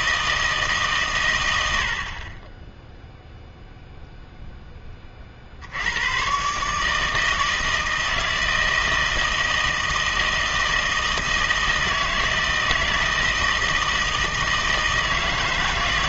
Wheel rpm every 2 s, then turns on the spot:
150, 10, 10, 150, 160, 160, 160, 160.
none